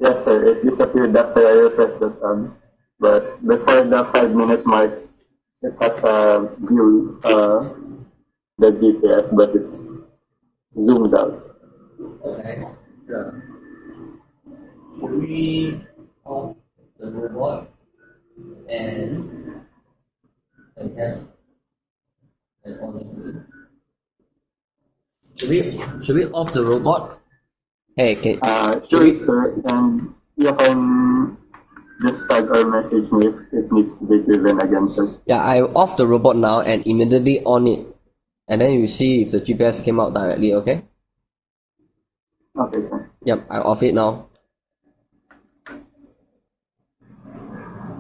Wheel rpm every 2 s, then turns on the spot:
0, 0, 0, 0, 0, 0, 0, 0, 0, 0, 0, 0, 0, 0, 0, 0, 0, 0, 0, 0, 0, 0, 0, 0.
none